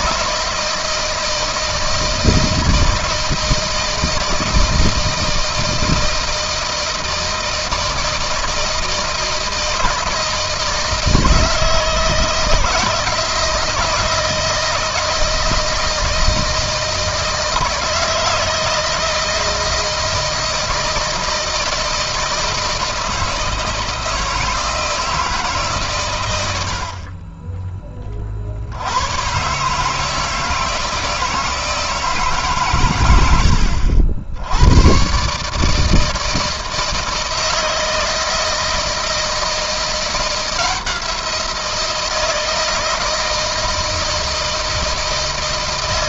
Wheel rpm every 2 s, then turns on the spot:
160, 160, 160, 160, 160, 160, 160, 160, 160, 160, 160, 160, 160, 100, 60, 160, 140, 100, 160, 160, 170, 160, 160.
none